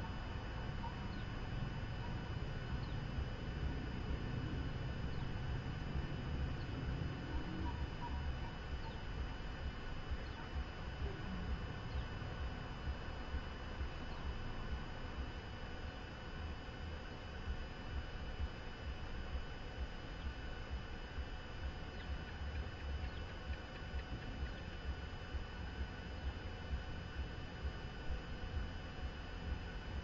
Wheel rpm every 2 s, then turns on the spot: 0, 0, 0, 0, 0, 0, 0, 0, 0, 0, 0, 0, 0, 0, 0.
none